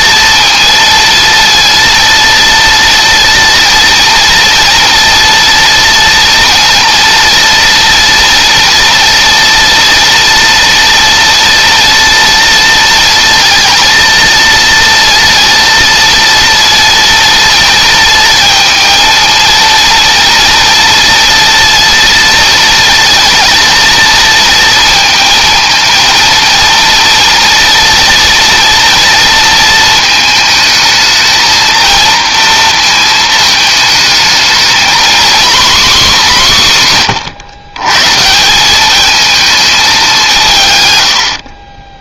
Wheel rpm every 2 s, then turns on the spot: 230, 230, 230, 230, 230, 230, 230, 230, 230, 230, 230, 230, 230, 230, 230, 220, 230, 230, 150, 200, 130.
none